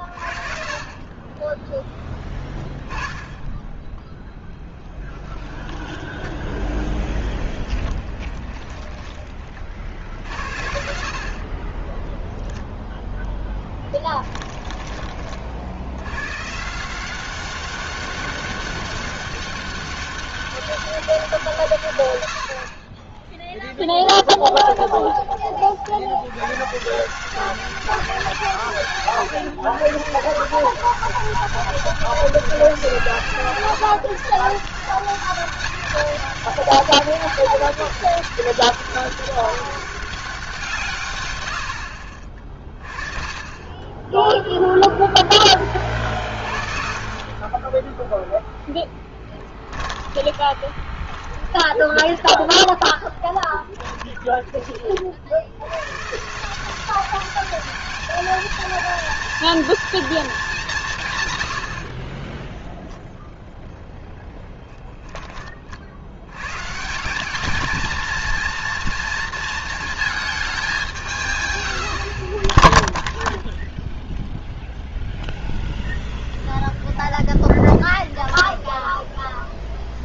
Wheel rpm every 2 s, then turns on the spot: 40, 10, 10, 10, 20, 70, 0, 20, 170, 190, 190, 30, 20, 140, 140, 190, 170, 170, 200, 200, 160, 30, 0, 40, 10, 20, 10, 40, 190, 230, 170, 0, 30, 170, 230, 190, 0, 0, 0, 0.
0-2 4-10 14-16 48-54 64-66